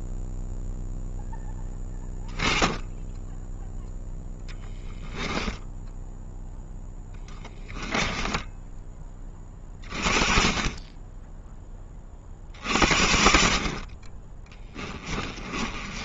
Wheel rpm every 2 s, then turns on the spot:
0, 10, 10, 10, 20, 20, 50, 20.
4-8 14-16